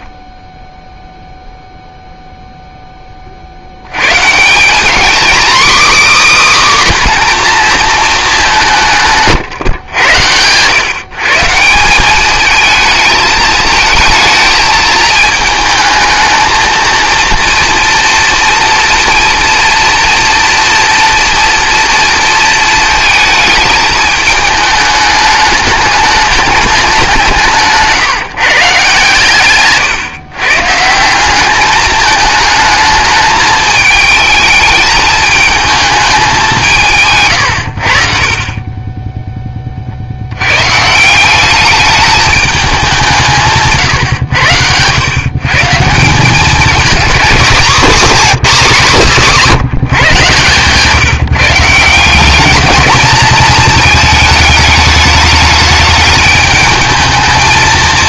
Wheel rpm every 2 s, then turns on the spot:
0, 0, 170, 280, 200, 110, 220, 220, 220, 230, 230, 230, 210, 210, 150, 150, 220, 220, 170, 20, 150, 200, 110, 220, 210, 160, 220, 210, 220.
none